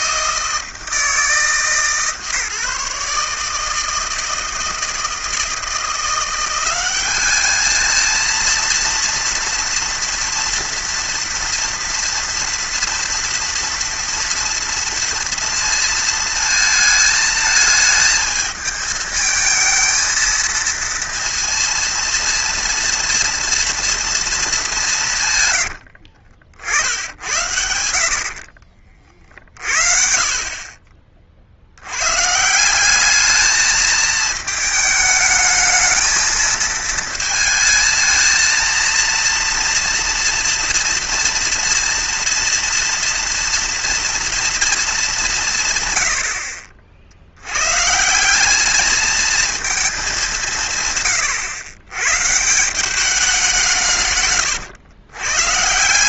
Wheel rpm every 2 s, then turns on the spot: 160, 150, 160, 180, 230, 230, 230, 230, 220, 220, 230, 230, 220, 60, 50, 50, 150, 220, 220, 220, 230, 230, 240, 80, 190, 180, 150, 130.
28-30 54-56